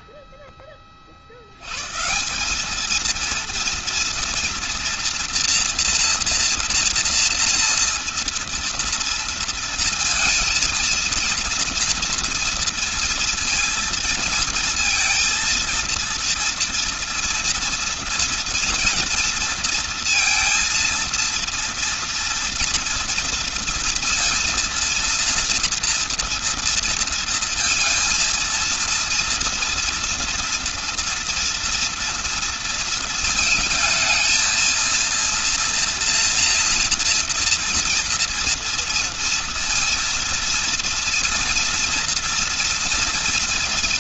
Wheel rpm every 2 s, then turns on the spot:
0, 170, 230, 230, 230, 230, 230, 230, 230, 230, 230, 230, 230, 230, 230, 240, 230, 220, 230, 230, 230, 230.
none